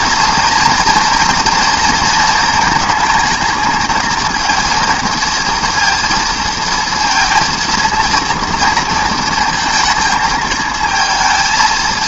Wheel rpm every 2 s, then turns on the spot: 230, 230, 220, 230, 230, 220.
none